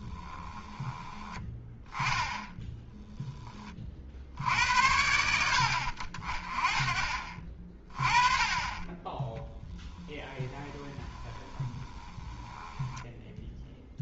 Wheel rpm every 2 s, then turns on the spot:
10, 0, 80, 30, 20, 20, 10.
0-2 8-12